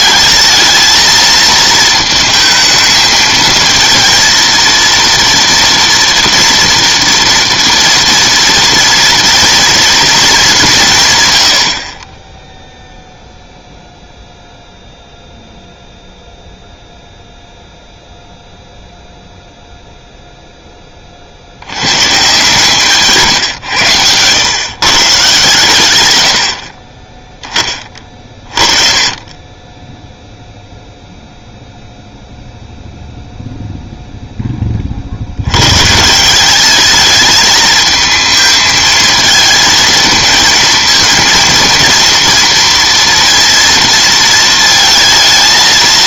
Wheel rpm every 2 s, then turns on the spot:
220, 220, 230, 230, 230, 190, 0, 0, 0, 0, 10, 150, 130, 40, 30, 0, 0, 30, 210, 220, 220, 230, 230.
none